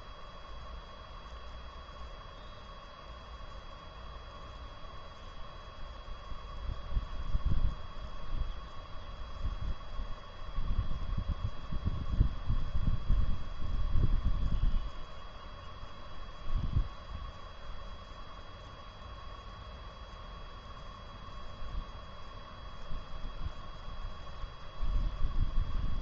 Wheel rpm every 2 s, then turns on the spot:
0, 0, 0, 0, 0, 0, 0, 0, 0, 0, 0, 0, 0.
none